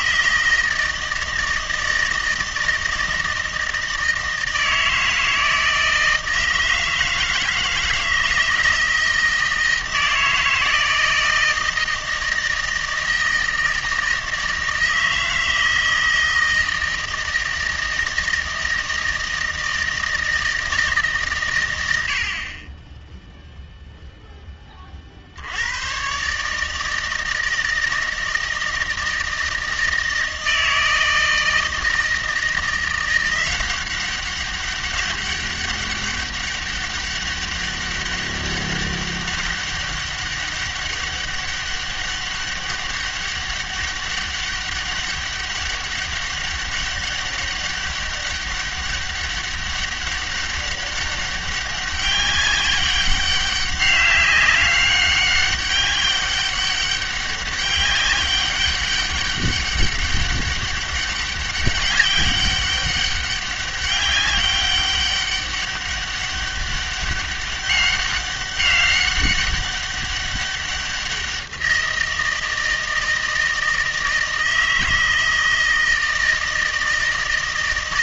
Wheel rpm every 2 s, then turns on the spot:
160, 160, 160, 160, 160, 160, 160, 160, 160, 160, 160, 20, 20, 150, 160, 160, 170, 190, 200, 200, 200, 200, 200, 200, 200, 200, 200, 200, 200, 200, 200, 200, 190, 200, 200, 190, 160, 160, 160.
none